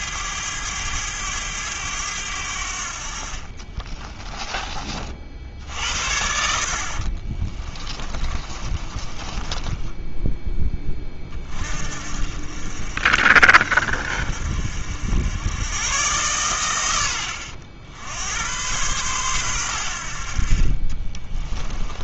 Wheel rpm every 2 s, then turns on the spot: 100, 80, 20, 60, 30, 20, 50, 60, 110, 110, 40.
8-10 20-22